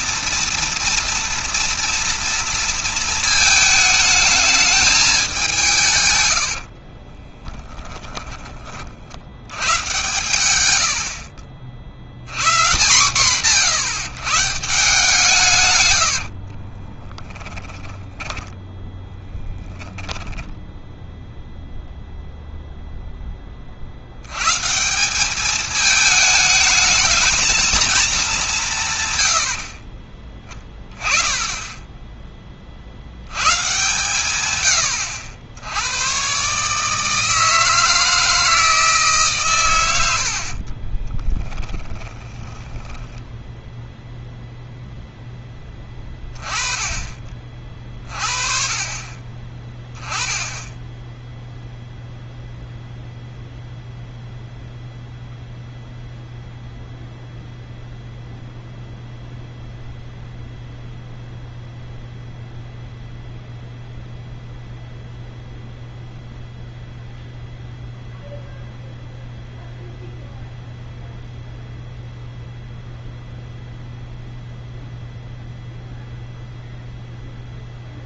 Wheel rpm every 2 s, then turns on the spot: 230, 230, 210, 70, 50, 80, 140, 160, 40, 10, 10, 0, 140, 210, 160, 10, 50, 110, 150, 160, 50, 10, 0, 20, 40, 10, 0, 0, 0, 0, 0, 0, 0, 0, 0, 0, 0, 0, 0.
6-8 16-22 40-44